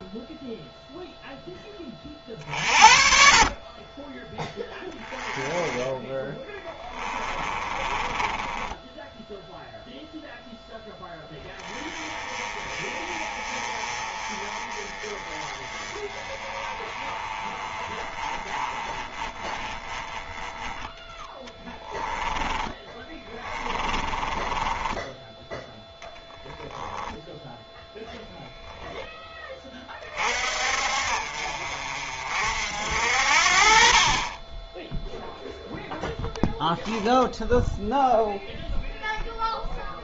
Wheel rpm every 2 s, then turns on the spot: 0, 50, 10, 20, 10, 10, 20, 20, 20, 20, 20, 10, 10, 0, 10, 50, 60, 10, 0, 0.
6-8 20-26